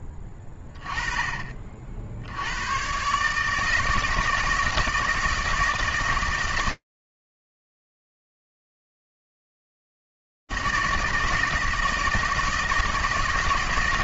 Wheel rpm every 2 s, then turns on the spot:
20, 150, 160, 160, 160, 160, 160.
none